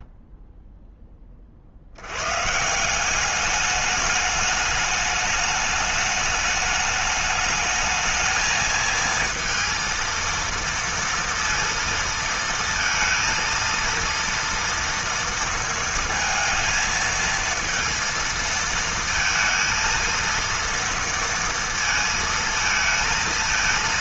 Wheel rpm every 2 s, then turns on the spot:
20, 180, 210, 210, 230, 230, 230, 230, 230, 230, 230, 230.
none